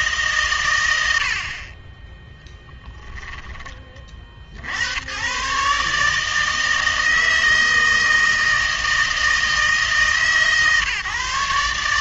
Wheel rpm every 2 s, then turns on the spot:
120, 10, 70, 160, 160, 140.
2-4